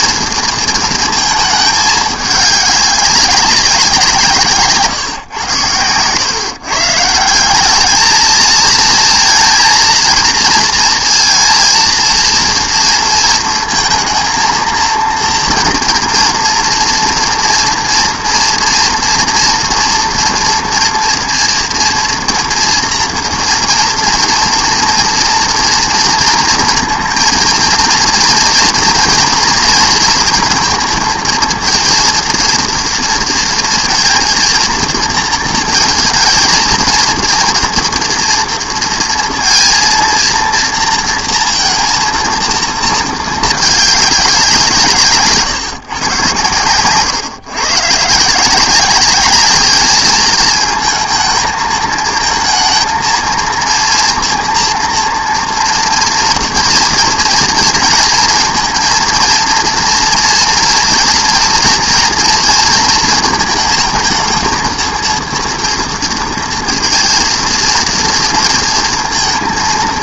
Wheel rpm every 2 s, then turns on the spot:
220, 200, 130, 150, 230, 230, 230, 230, 240, 230, 230, 230, 240, 230, 240, 230, 230, 230, 230, 230, 230, 220, 160, 120, 200, 220, 220, 230, 230, 230, 230, 230, 230, 230, 230.
none